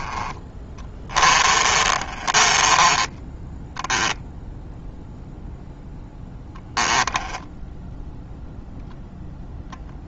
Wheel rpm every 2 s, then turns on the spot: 20, 20, 0, 0, 0.
0-4